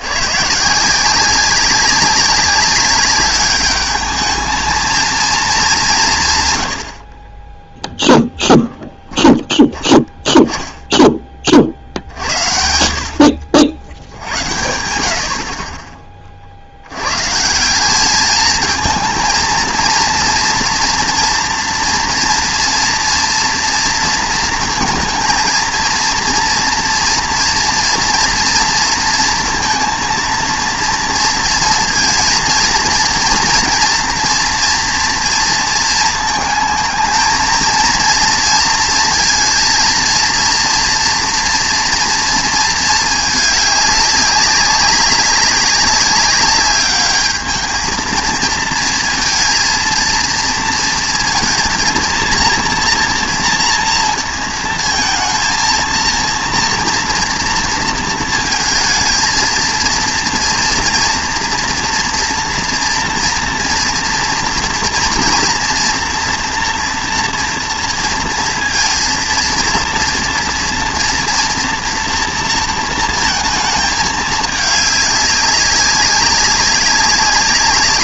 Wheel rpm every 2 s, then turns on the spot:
150, 190, 220, 70, 10, 10, 70, 80, 60, 220, 230, 230, 230, 230, 230, 230, 230, 230, 220, 230, 230, 230, 200, 200, 230, 230, 230, 230, 230, 230, 230, 240, 230, 230, 230, 230, 230, 210, 200.
none